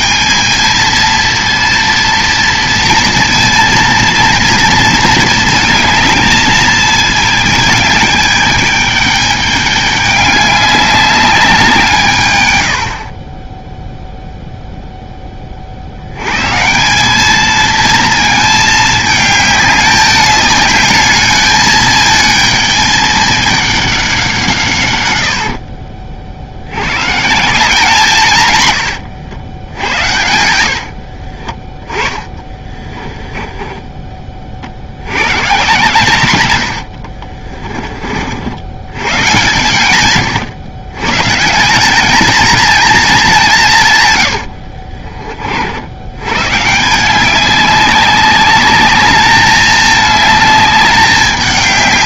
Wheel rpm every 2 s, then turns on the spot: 220, 230, 230, 220, 210, 200, 90, 0, 150, 220, 210, 220, 150, 70, 120, 80, 20, 50, 100, 80, 110, 220, 80, 140, 200, 210.
28-34 44-46